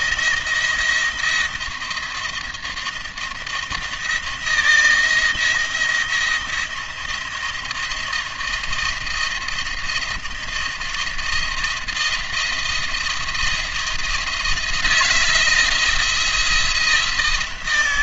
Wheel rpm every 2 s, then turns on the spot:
170, 170, 170, 170, 170, 170, 170, 160, 170.
none